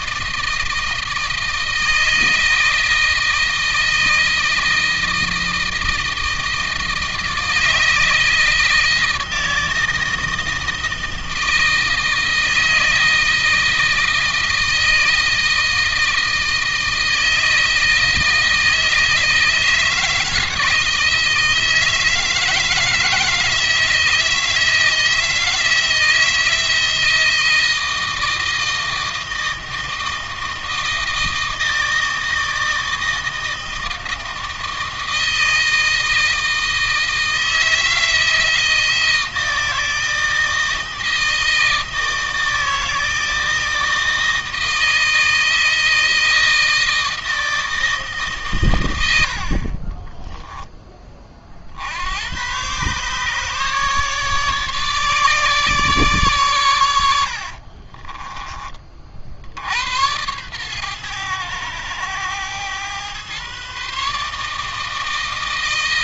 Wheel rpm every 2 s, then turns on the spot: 160, 160, 160, 160, 160, 160, 160, 160, 160, 160, 160, 160, 160, 160, 160, 160, 160, 160, 160, 160, 160, 160, 160, 160, 110, 20, 130, 150, 100, 30, 110, 120, 160.
56-58